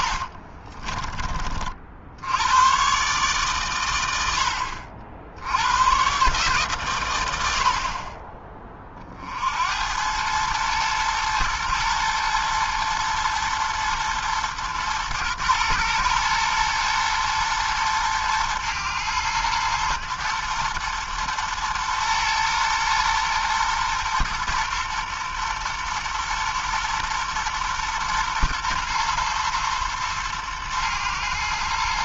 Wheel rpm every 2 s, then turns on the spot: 30, 130, 70, 120, 40, 120, 110, 110, 120, 110, 120, 120, 120, 120, 120, 110.
0-2